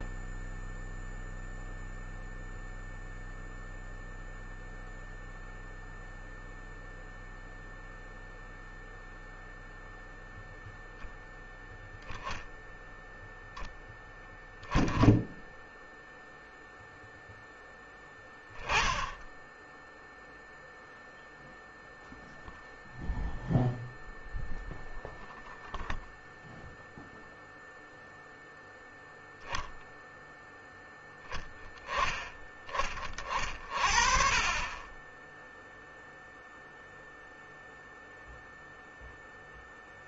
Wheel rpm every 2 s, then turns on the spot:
0, 0, 0, 0, 0, 10, 0, 10, 0, 10, 0, 0, 0, 0, 0, 0, 20, 20, 0, 0.
none